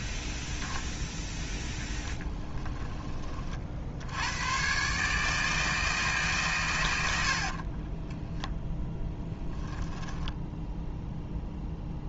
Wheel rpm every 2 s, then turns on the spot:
10, 20, 130, 120, 10, 0.
2-4